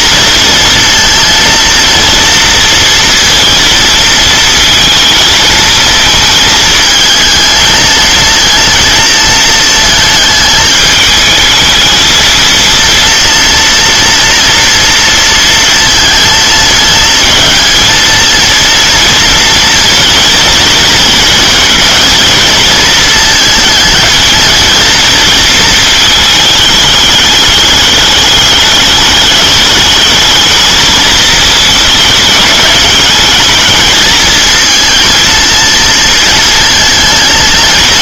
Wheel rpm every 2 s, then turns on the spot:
230, 230, 220, 220, 230, 220, 230, 240, 220, 230, 230, 220, 230, 210, 200, 220, 210, 230, 230.
none